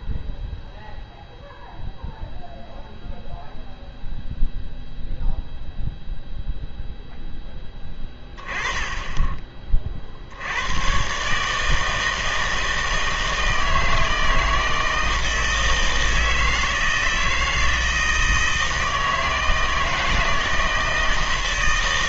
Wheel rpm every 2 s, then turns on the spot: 0, 0, 0, 0, 10, 110, 160, 160, 160, 160, 160.
none